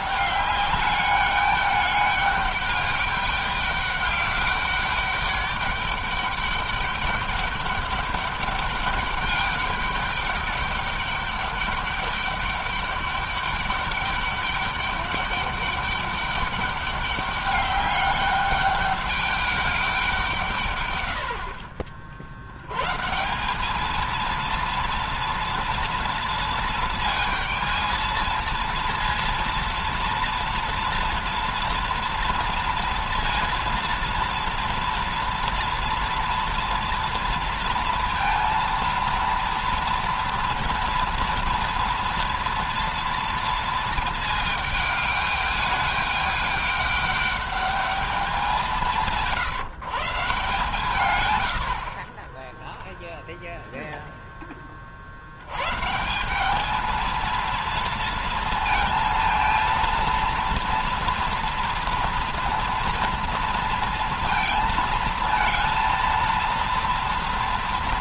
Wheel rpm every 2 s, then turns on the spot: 200, 210, 200, 200, 200, 200, 200, 200, 200, 200, 150, 80, 230, 230, 220, 230, 230, 240, 230, 230, 230, 230, 220, 200, 200, 150, 10, 20, 200, 230, 230, 230, 230, 230.
none